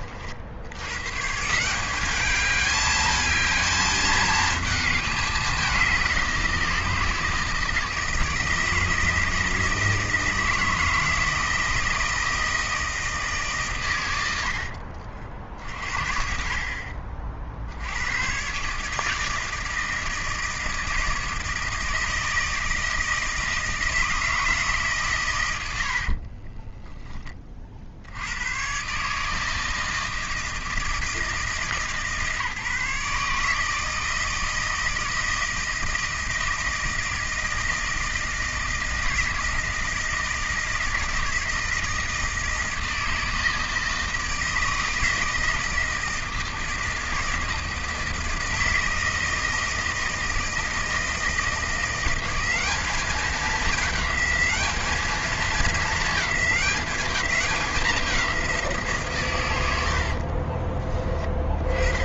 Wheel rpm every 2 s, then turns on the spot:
90, 210, 220, 170, 160, 160, 160, 60, 50, 140, 160, 160, 160, 30, 110, 160, 150, 160, 160, 160, 160, 160, 160, 160, 160, 160, 200, 210, 210, 170, 30.
26-28 60-62